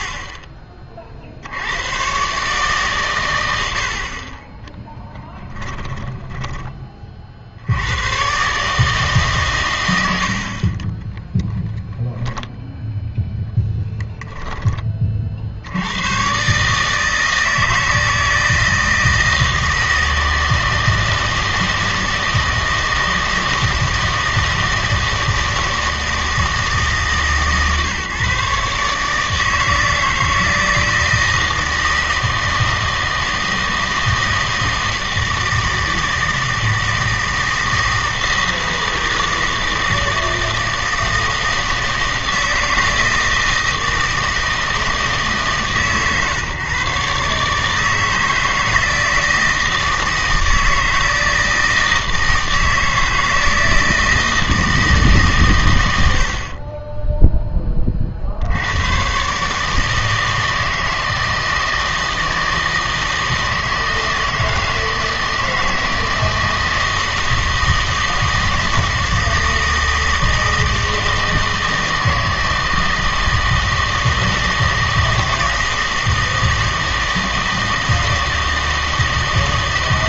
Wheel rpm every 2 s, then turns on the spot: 30, 140, 20, 20, 140, 40, 0, 10, 150, 160, 160, 160, 160, 160, 150, 160, 160, 160, 160, 160, 160, 160, 160, 140, 160, 160, 160, 160, 40, 90, 160, 160, 160, 160, 160, 160, 160, 160, 160, 160.
56-58